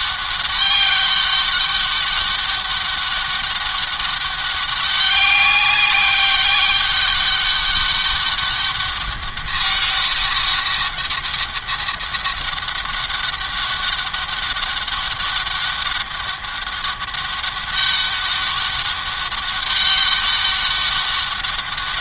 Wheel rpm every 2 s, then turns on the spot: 200, 200, 200, 200, 200, 200, 200, 200, 200, 200, 190.
none